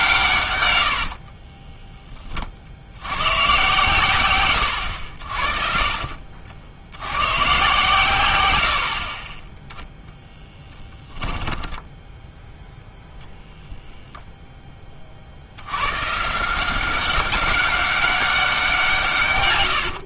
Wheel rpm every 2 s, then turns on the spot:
100, 70, 100, 90, 70, 10, 10, 10, 170, 170.
0-2 10-12